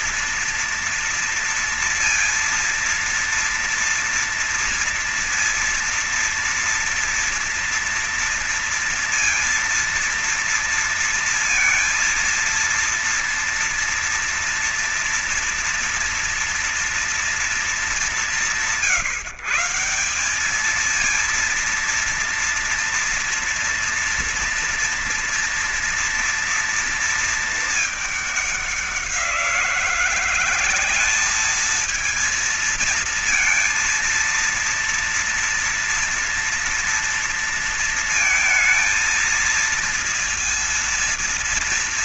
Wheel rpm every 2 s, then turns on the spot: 230, 230, 230, 230, 230, 230, 230, 230, 230, 170, 200, 230, 230, 230, 200, 180, 230, 230, 230, 230, 230.
none